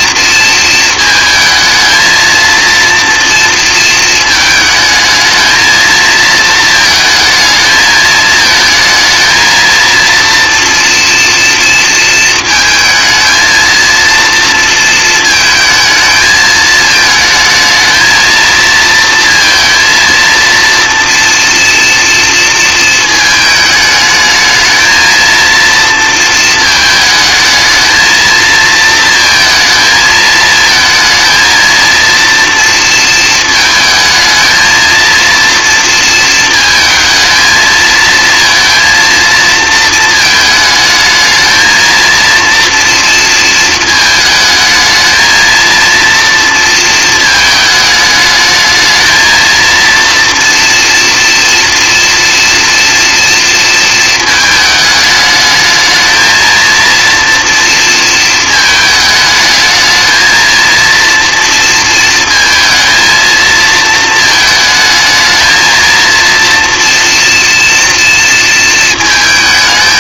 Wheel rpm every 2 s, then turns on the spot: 230, 230, 220, 230, 220, 230, 220, 230, 220, 230, 230, 230, 220, 220, 230, 220, 230, 230, 220, 230, 220, 230, 220, 230, 220, 240, 230, 210, 230, 220, 230, 230, 220, 240, 230.
none